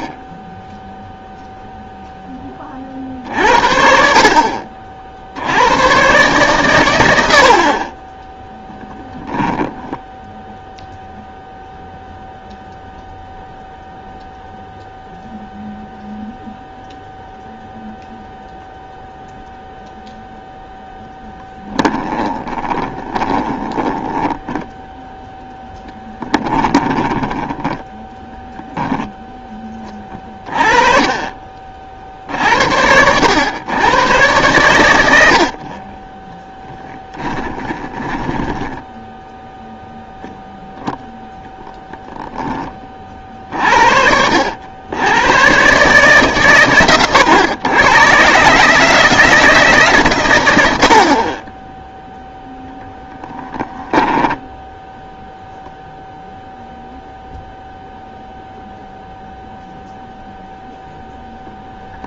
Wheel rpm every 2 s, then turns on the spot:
0, 50, 50, 110, 10, 0, 0, 0, 0, 0, 0, 20, 10, 20, 10, 30, 80, 100, 10, 10, 10, 40, 90, 110, 150, 70, 0, 0, 0, 0, 0.
22-24 26-28 36-40